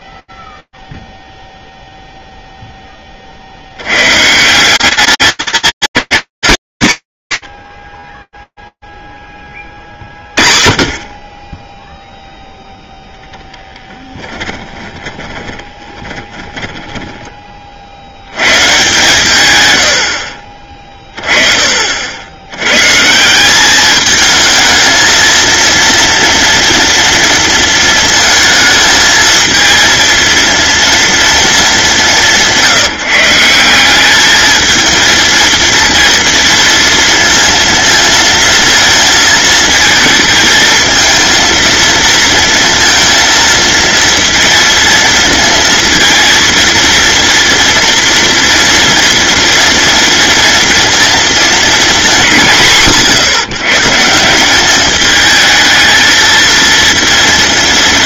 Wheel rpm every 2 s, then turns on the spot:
10, 0, 160, 210, 20, 40, 0, 20, 10, 130, 30, 180, 230, 230, 220, 230, 170, 230, 230, 220, 230, 230, 230, 230, 230, 230, 130, 220, 230.
14-18